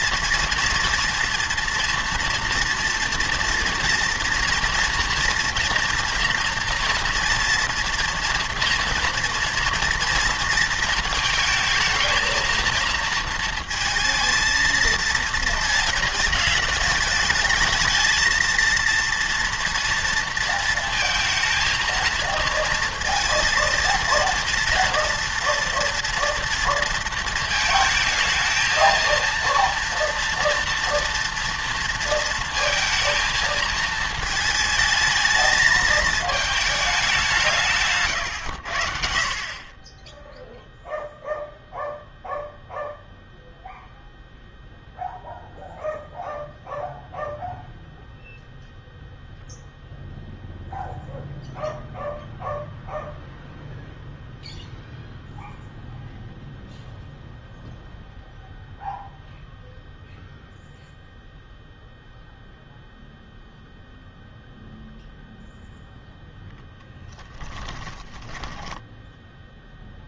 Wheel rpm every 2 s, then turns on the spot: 230, 230, 240, 240, 230, 230, 220, 230, 220, 230, 230, 230, 230, 230, 220, 240, 230, 220, 210, 80, 0, 0, 0, 0, 0, 0, 0, 0, 0, 0, 0, 0, 0, 10, 10.
68-70